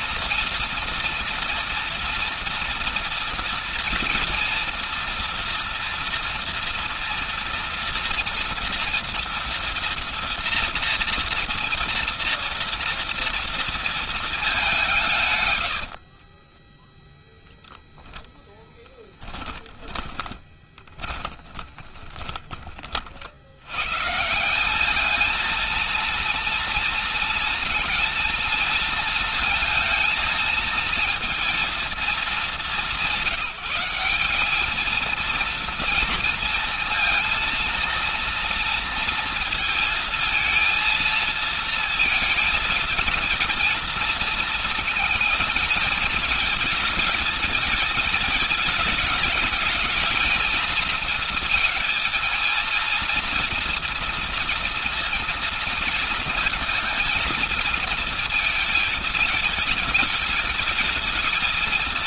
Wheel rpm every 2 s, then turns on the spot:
240, 230, 230, 230, 230, 230, 230, 180, 10, 10, 20, 50, 210, 230, 230, 230, 180, 220, 230, 230, 230, 230, 220, 220, 220, 230, 230, 230, 220, 220, 220.
16-22